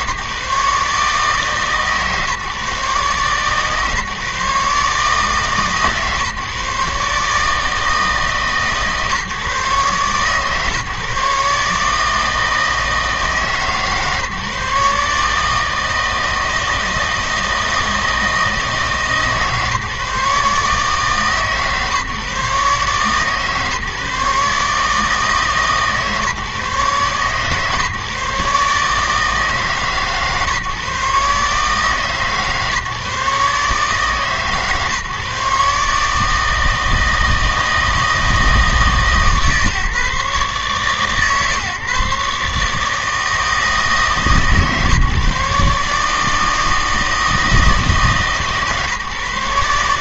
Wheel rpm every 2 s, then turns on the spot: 150, 150, 150, 140, 140, 140, 160, 150, 160, 160, 150, 140, 150, 140, 150, 140, 140, 150, 160, 160, 140, 150, 140, 160, 150.
none